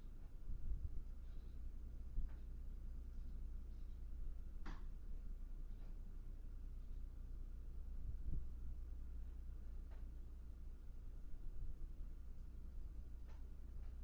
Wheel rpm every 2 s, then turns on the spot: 0, 0, 0, 0, 0, 0, 0.
none